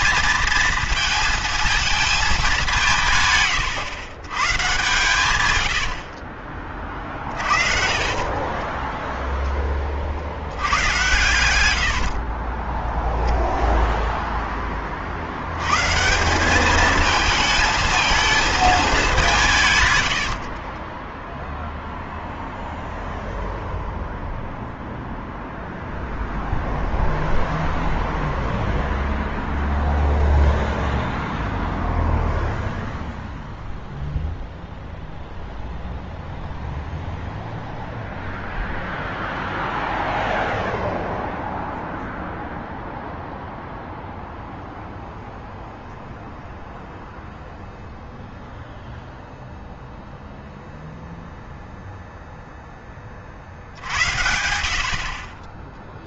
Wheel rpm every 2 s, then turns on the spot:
230, 180, 120, 30, 20, 90, 10, 20, 200, 220, 40, 0, 0, 0, 0, 0, 0, 0, 0, 0, 0, 0, 0, 0, 0, 0, 10, 70.
6-12 20-22